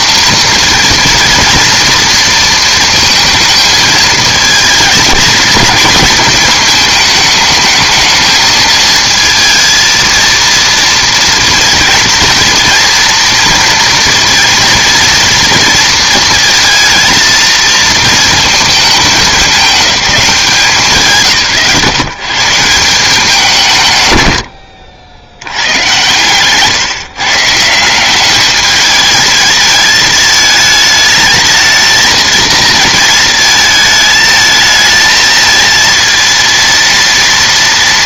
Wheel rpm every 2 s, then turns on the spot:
230, 230, 220, 220, 220, 230, 230, 230, 230, 220, 150, 170, 40, 140, 210, 220, 220, 220, 230.
none